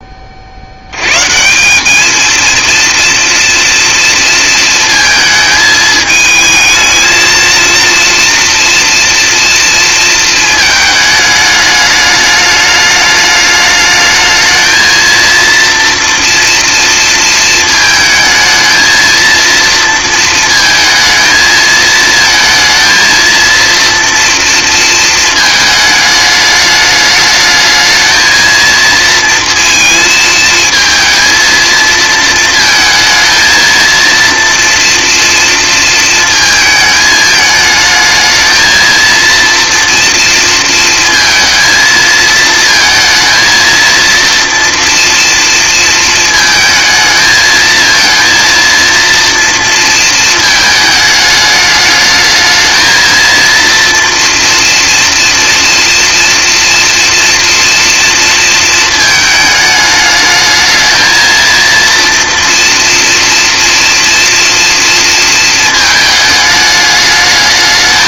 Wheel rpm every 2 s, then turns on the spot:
120, 230, 230, 220, 230, 210, 210, 230, 230, 230, 220, 230, 230, 210, 230, 220, 230, 230, 220, 230, 230, 220, 230, 220, 230, 220, 220, 230, 240, 220, 220, 230, 230, 210.
none